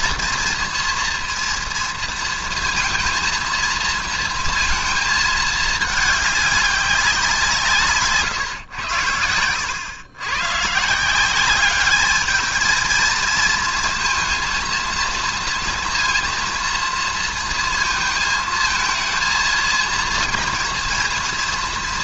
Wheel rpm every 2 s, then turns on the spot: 230, 230, 220, 200, 110, 150, 220, 230, 230, 230, 230.
none